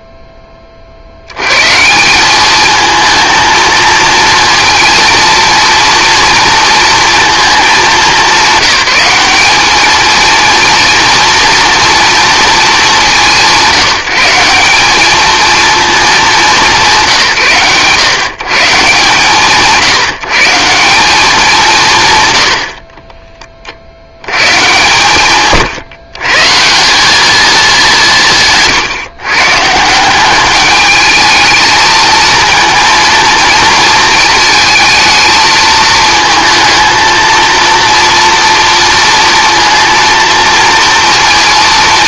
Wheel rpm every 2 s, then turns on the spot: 20, 210, 230, 230, 200, 230, 220, 180, 190, 150, 180, 70, 120, 150, 140, 210, 230, 220, 220, 230, 230.
none